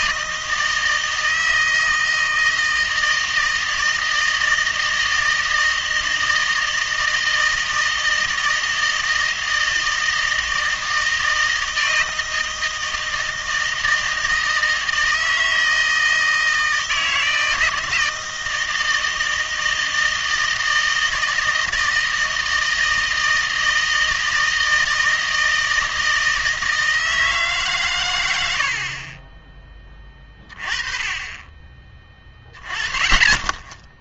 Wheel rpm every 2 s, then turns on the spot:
160, 160, 160, 160, 160, 160, 160, 160, 160, 160, 160, 160, 160, 160, 80, 30, 20.
none